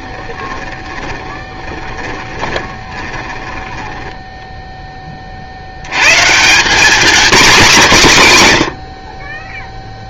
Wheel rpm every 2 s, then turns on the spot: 10, 20, 10, 200, 120.
0-4